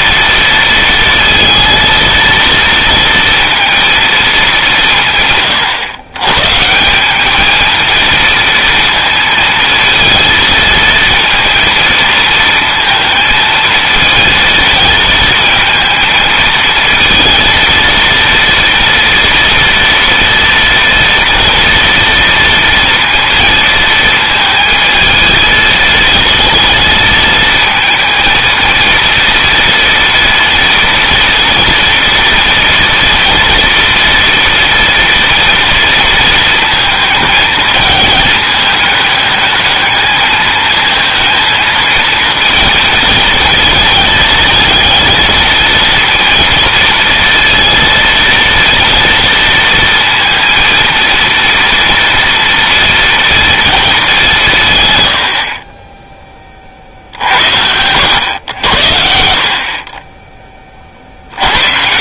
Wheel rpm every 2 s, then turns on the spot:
230, 230, 180, 170, 230, 230, 230, 220, 230, 230, 230, 230, 220, 220, 230, 230, 230, 230, 220, 210, 220, 230, 220, 230, 230, 230, 230, 130, 30, 80, 30.
none